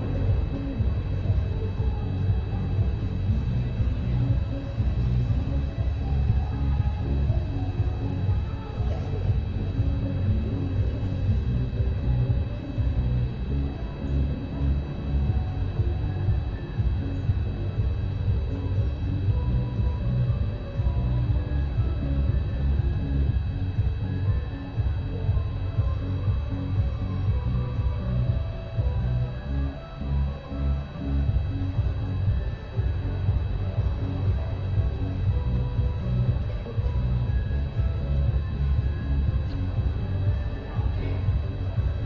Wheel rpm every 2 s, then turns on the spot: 0, 0, 0, 0, 0, 0, 0, 0, 0, 0, 0, 0, 0, 0, 0, 0, 0, 0, 0, 0, 0.
none